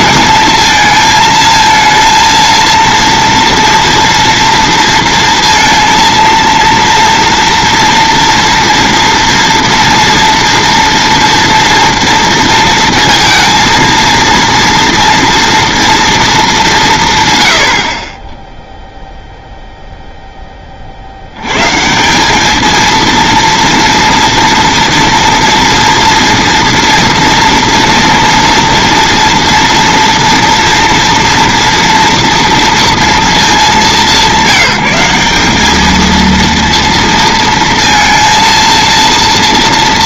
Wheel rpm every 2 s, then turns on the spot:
230, 230, 230, 230, 240, 230, 230, 230, 200, 10, 10, 210, 230, 230, 230, 230, 230, 190, 230, 230.
none